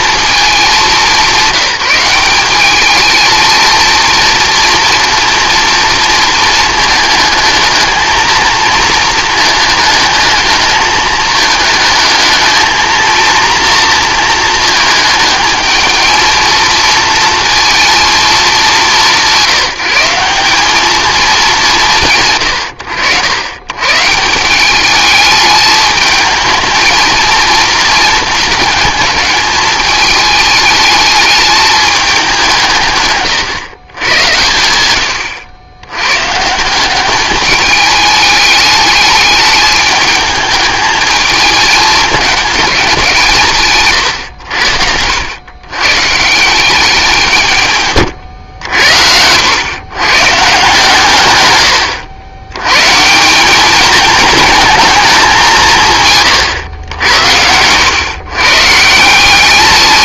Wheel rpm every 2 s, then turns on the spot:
210, 200, 230, 230, 220, 220, 220, 220, 220, 200, 190, 110, 190, 220, 210, 220, 170, 110, 160, 210, 220, 200, 90, 170, 90, 140, 120, 210, 110, 150.
none